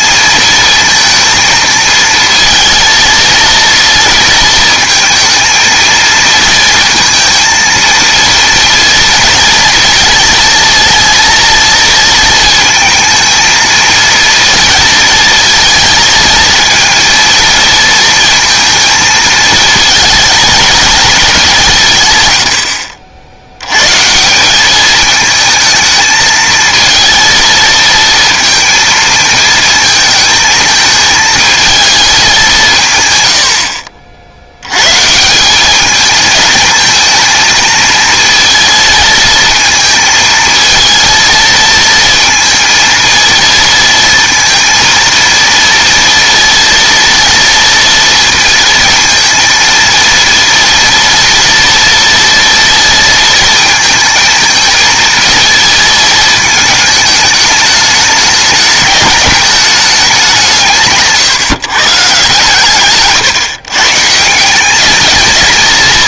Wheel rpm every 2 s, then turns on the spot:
220, 230, 220, 230, 230, 230, 220, 230, 230, 230, 220, 70, 200, 230, 230, 220, 140, 110, 220, 230, 230, 230, 230, 230, 230, 240, 230, 220, 220, 210, 170, 130, 190.
none